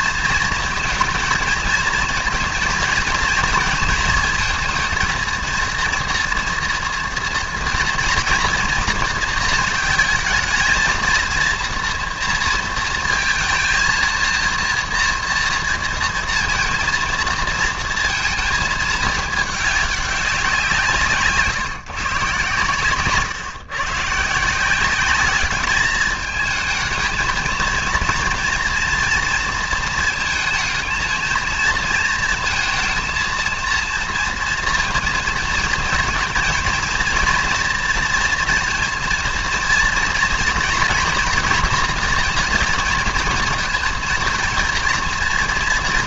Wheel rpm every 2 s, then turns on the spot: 220, 230, 230, 230, 230, 230, 230, 230, 230, 220, 180, 130, 180, 220, 230, 230, 230, 230, 230, 230, 230, 230, 230.
none